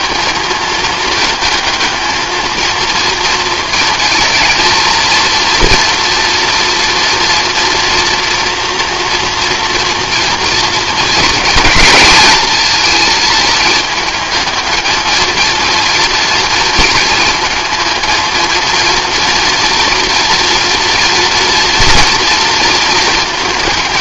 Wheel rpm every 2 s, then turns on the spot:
220, 230, 230, 230, 230, 230, 230, 220, 220, 230, 230, 220.
none